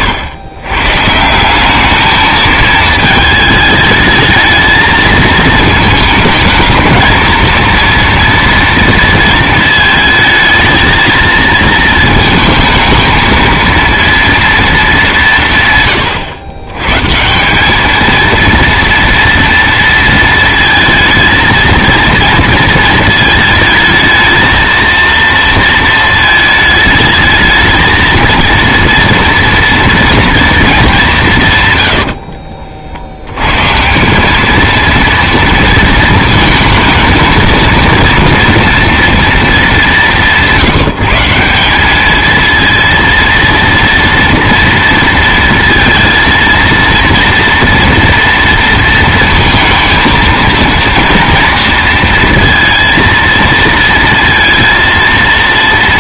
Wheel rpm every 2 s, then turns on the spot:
130, 220, 220, 220, 230, 220, 220, 210, 110, 230, 230, 230, 230, 220, 230, 210, 60, 220, 220, 230, 180, 230, 230, 230, 230, 230, 230, 230.
none